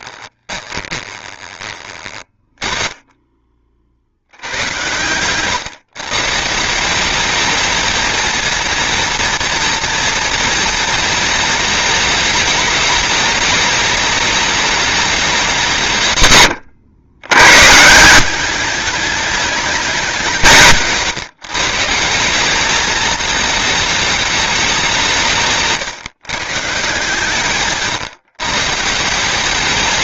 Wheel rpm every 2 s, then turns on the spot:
20, 20, 110, 160, 230, 230, 220, 210, 110, 200, 170, 210, 200, 150, 150.
0-2